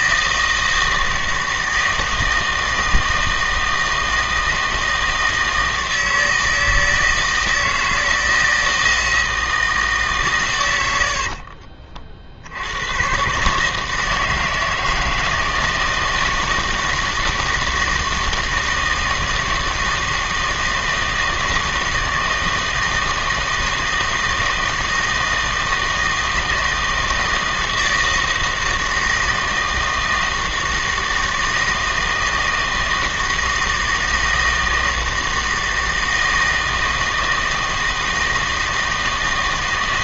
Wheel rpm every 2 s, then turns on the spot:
160, 160, 160, 160, 160, 90, 90, 160, 160, 160, 160, 160, 160, 160, 160, 160, 160, 160, 160, 160.
none